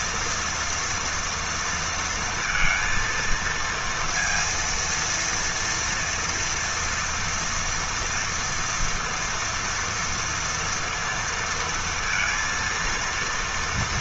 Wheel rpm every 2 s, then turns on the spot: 240, 230, 230, 230, 230, 230, 230.
none